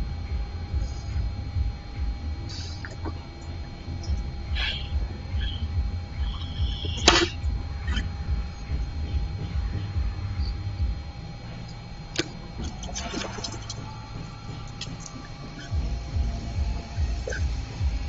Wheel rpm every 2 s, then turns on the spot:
0, 0, 0, 0, 0, 0, 0, 0, 0.
none